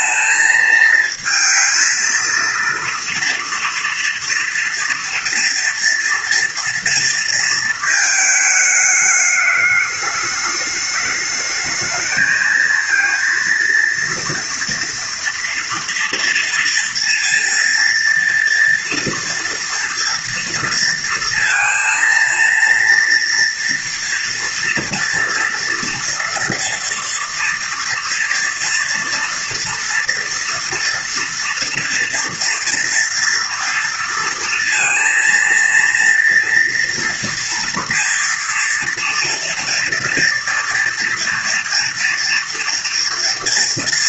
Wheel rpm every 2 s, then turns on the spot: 230, 230, 230, 230, 210, 210, 230, 230, 230, 230, 230, 230, 240, 230, 230, 240, 230, 230, 230, 230, 240, 230.
none